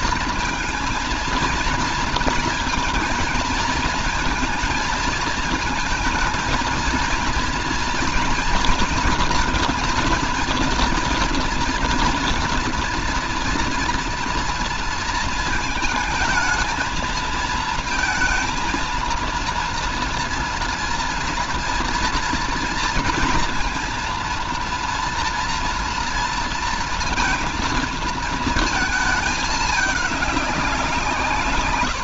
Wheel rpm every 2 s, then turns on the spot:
230, 230, 230, 230, 230, 230, 230, 230, 220, 230, 230, 230, 230, 230, 230, 200.
none